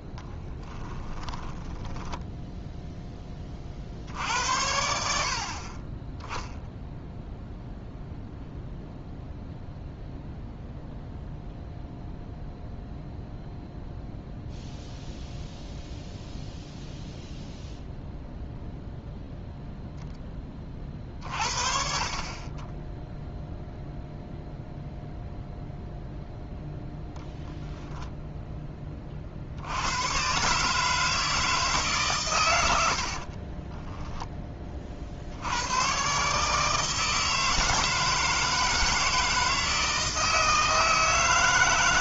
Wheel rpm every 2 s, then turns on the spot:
20, 0, 70, 0, 0, 0, 0, 0, 0, 0, 30, 10, 0, 0, 20, 150, 90, 30, 160, 160, 160.
0-2